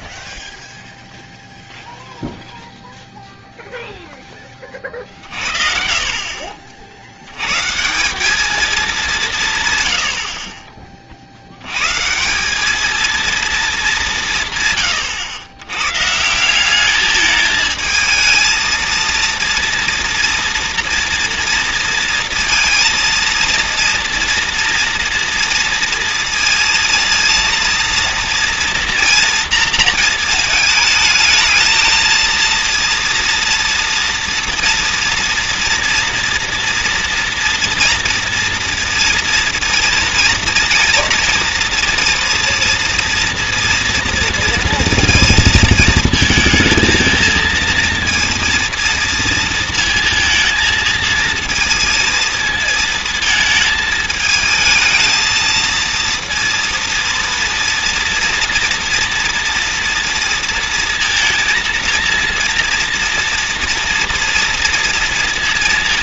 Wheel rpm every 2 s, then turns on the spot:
0, 0, 30, 60, 230, 50, 200, 130, 200, 220, 230, 230, 230, 230, 230, 220, 230, 230, 230, 230, 230, 230, 230, 220, 230, 230, 220, 220, 230, 230, 230, 230, 230.
none